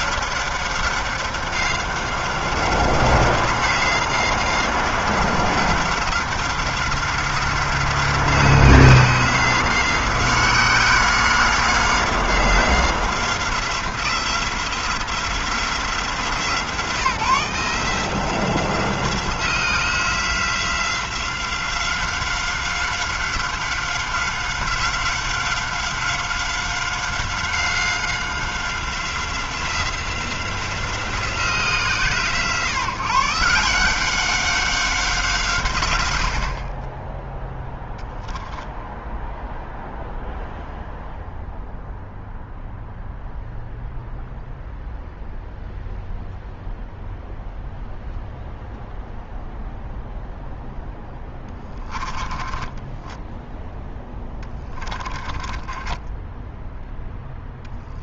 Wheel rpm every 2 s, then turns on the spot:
190, 180, 180, 180, 190, 180, 180, 180, 170, 180, 180, 190, 190, 190, 180, 160, 160, 170, 0, 0, 0, 0, 0, 0, 0, 20, 10, 30, 0.
50-52 54-56